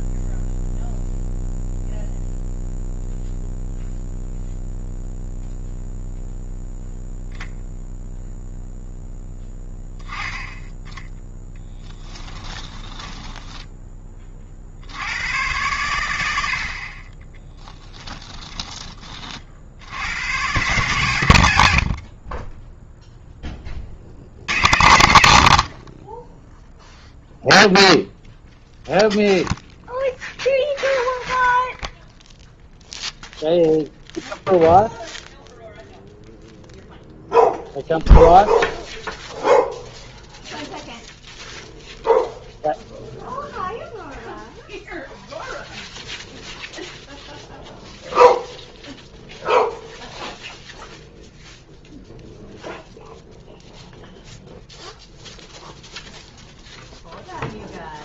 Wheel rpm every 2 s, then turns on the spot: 0, 0, 0, 0, 0, 10, 10, 70, 40, 20, 120, 0, 80, 0, 0, 0, 0, 0, 0, 0, 0, 0, 0, 0, 0, 0, 0, 0, 0.
12-14